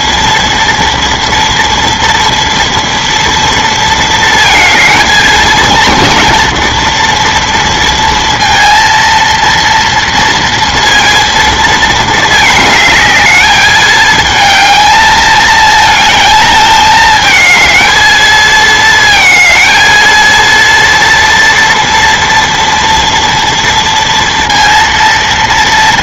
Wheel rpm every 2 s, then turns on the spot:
230, 230, 220, 230, 230, 230, 210, 220, 220, 220, 230, 230, 230.
none